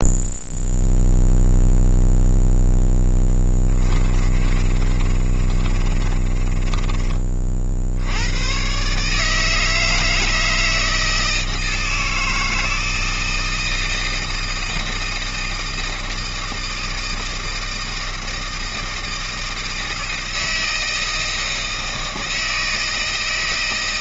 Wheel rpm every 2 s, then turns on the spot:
0, 0, 30, 20, 130, 160, 160, 160, 160, 160, 160, 160.
4-8